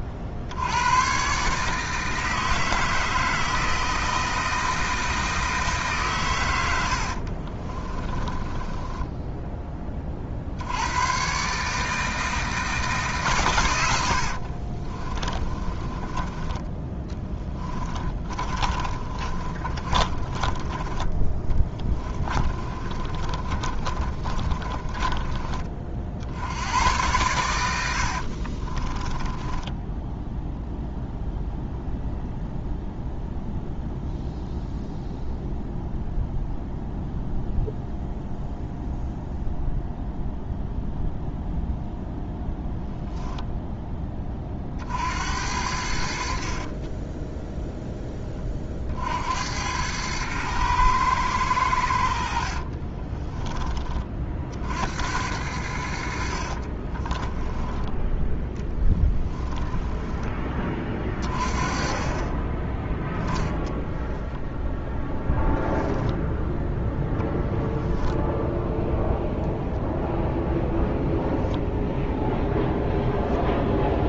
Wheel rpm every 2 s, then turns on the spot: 80, 160, 160, 80, 20, 90, 150, 40, 10, 30, 20, 30, 30, 90, 30, 0, 0, 0, 0, 0, 0, 0, 50, 40, 40, 110, 40, 70, 30, 10, 20, 10, 10, 10, 0, 0, 0.
6-10 14-16 18-26 28-30 46-48 52-54 56-60